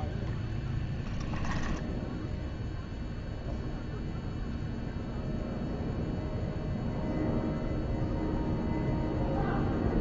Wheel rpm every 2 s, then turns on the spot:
10, 0, 0, 0, 0.
0-2